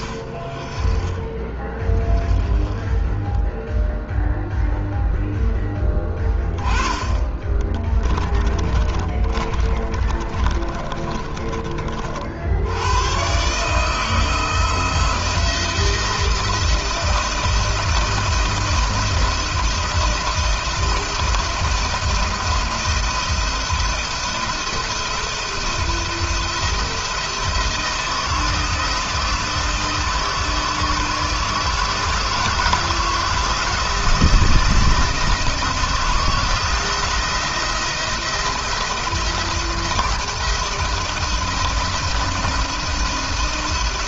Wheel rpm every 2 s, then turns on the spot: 40, 20, 0, 10, 20, 30, 80, 160, 170, 170, 160, 170, 170, 170, 170, 160, 160, 170, 160, 170, 170, 170.
8-12